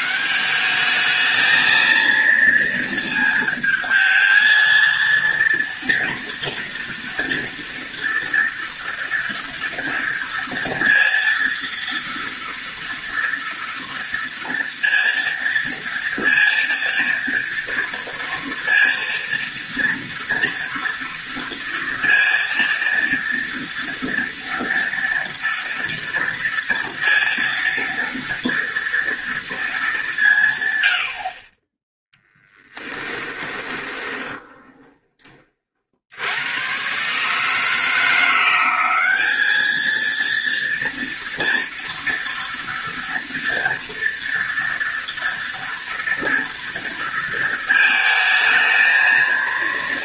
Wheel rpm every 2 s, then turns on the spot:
200, 230, 230, 230, 230, 230, 230, 230, 230, 230, 230, 230, 230, 230, 230, 90, 10, 20, 120, 190, 230, 230, 230, 230, 220.
32-34